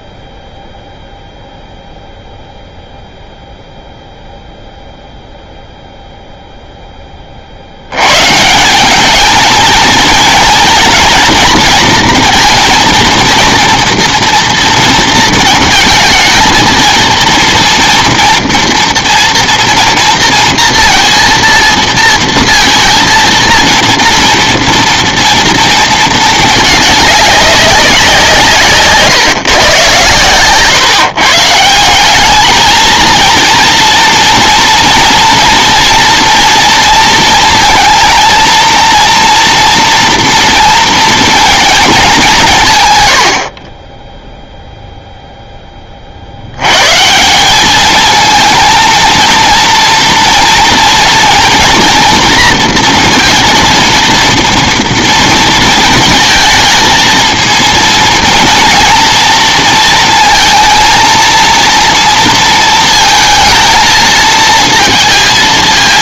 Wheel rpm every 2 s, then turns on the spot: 0, 0, 0, 10, 190, 230, 230, 230, 220, 230, 230, 230, 230, 210, 140, 150, 220, 230, 230, 230, 230, 130, 0, 130, 220, 230, 230, 230, 230, 230, 230, 220, 230.
none